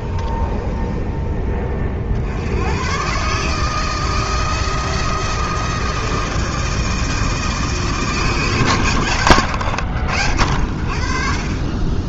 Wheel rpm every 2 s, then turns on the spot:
20, 110, 160, 160, 130, 60.
0-2